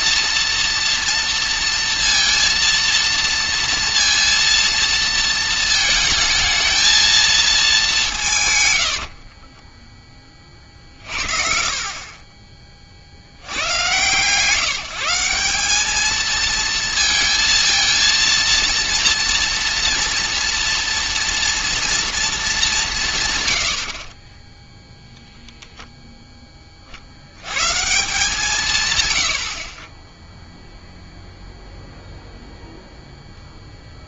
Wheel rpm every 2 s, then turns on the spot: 230, 230, 230, 220, 100, 50, 30, 170, 230, 230, 230, 210, 10, 10, 140, 0, 0.
24-26